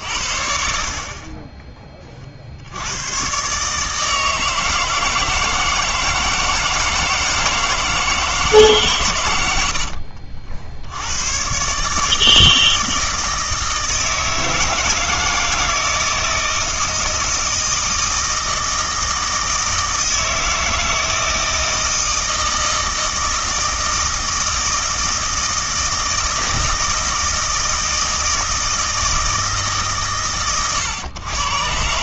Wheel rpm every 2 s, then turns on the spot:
60, 70, 160, 160, 150, 60, 160, 160, 160, 160, 160, 160, 160, 160, 160, 130.
none